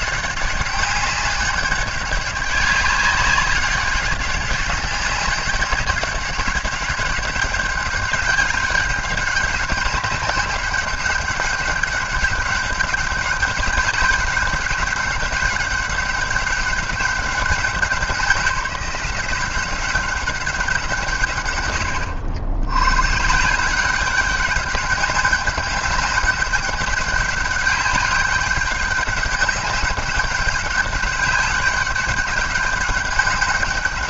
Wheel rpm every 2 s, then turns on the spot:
200, 200, 200, 200, 200, 200, 190, 190, 200, 180, 160, 110, 200, 200, 200, 200, 200.
none